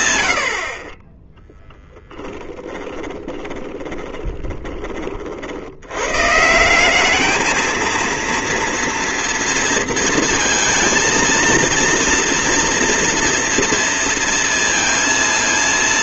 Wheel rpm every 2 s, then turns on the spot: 30, 40, 40, 180, 230, 230, 230, 230.
2-4